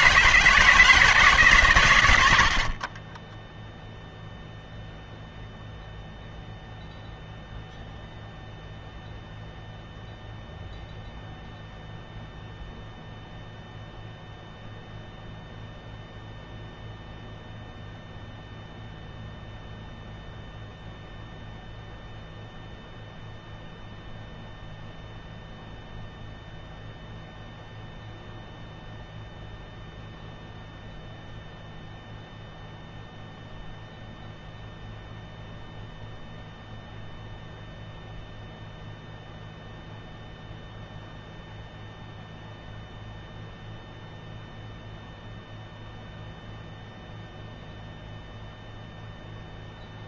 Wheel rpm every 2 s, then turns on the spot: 160, 40, 0, 0, 0, 0, 0, 0, 0, 0, 0, 0, 0, 0, 0, 0, 0, 0, 0, 0, 0, 0, 0, 0, 0.
none